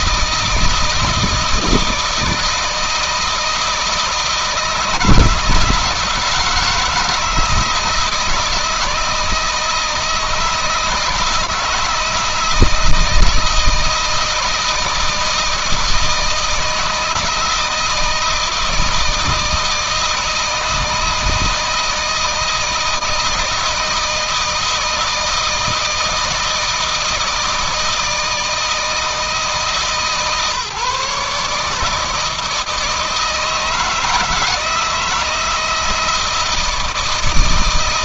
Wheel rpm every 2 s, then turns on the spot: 160, 160, 160, 160, 160, 160, 160, 160, 160, 160, 160, 160, 160, 160, 160, 140, 160, 160, 160.
none